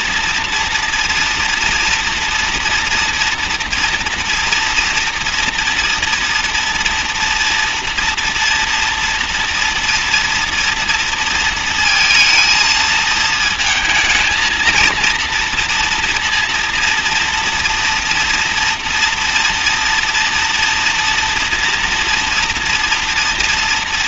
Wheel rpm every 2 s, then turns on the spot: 230, 230, 230, 240, 230, 230, 220, 230, 230, 230, 230, 230.
none